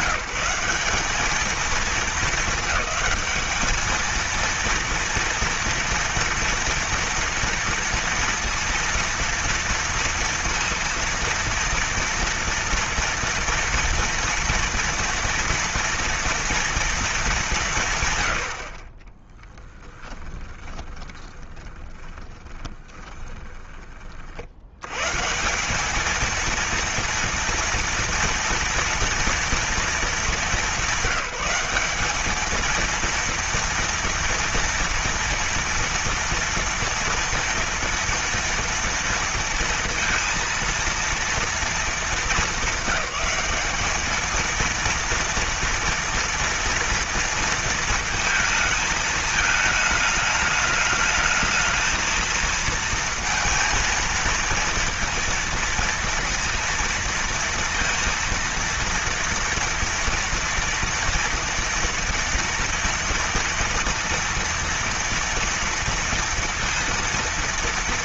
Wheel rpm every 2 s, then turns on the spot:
190, 220, 230, 230, 230, 230, 230, 240, 230, 50, 20, 20, 80, 230, 230, 200, 220, 230, 230, 230, 230, 210, 230, 230, 220, 210, 230, 230, 230, 230, 240, 230, 230, 230.
20-24